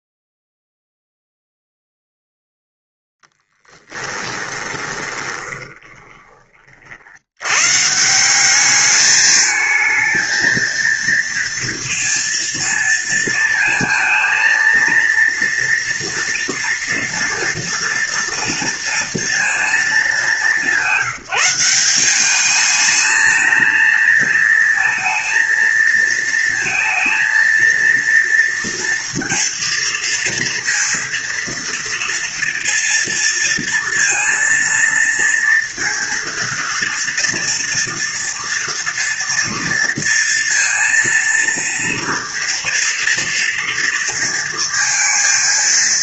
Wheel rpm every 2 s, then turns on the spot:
0, 0, 20, 40, 200, 230, 230, 230, 230, 230, 210, 200, 220, 230, 230, 230, 230, 230, 230, 230, 230, 230, 230.
4-6